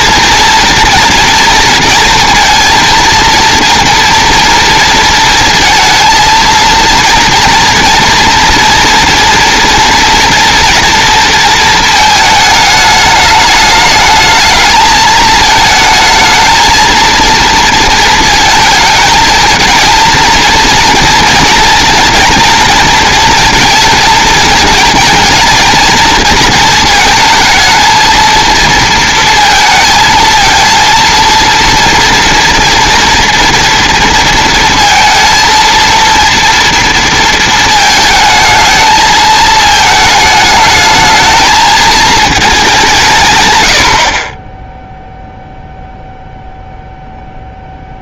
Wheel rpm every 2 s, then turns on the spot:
230, 230, 230, 230, 230, 240, 210, 220, 220, 220, 230, 230, 230, 220, 230, 230, 230, 230, 230, 220, 220, 170, 0, 0.
none